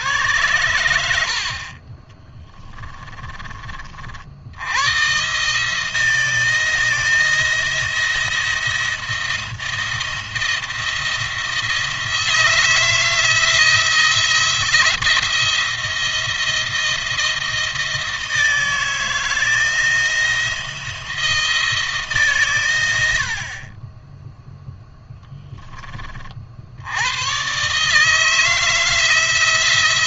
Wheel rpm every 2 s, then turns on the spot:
90, 20, 90, 160, 170, 170, 160, 160, 170, 160, 170, 110, 0, 70, 160.
2-4